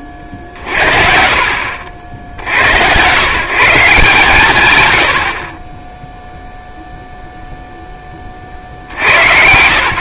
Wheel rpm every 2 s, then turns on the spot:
30, 100, 100, 0, 30.
none